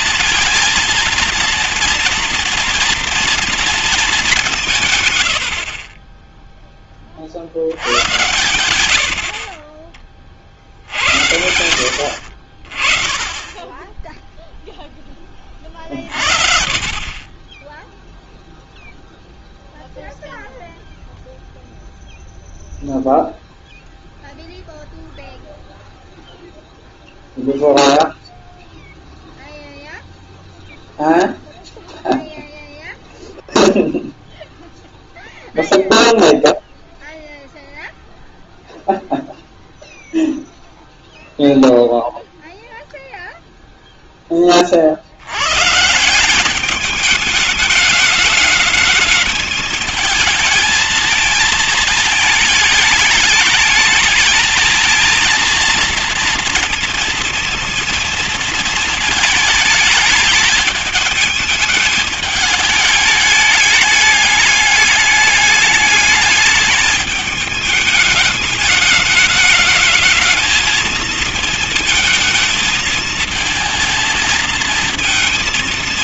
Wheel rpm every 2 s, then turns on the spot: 230, 240, 170, 20, 80, 60, 40, 0, 40, 0, 0, 0, 0, 0, 0, 0, 0, 0, 0, 0, 0, 0, 40, 200, 210, 220, 220, 230, 230, 220, 210, 210, 210, 220, 210, 220, 220, 230.
none